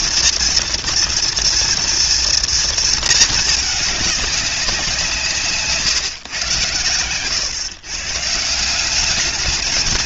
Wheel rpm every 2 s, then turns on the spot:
230, 230, 200, 110, 170.
none